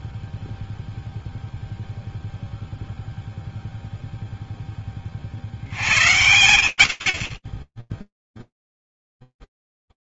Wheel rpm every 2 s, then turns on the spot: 0, 0, 110, 10, 0.
none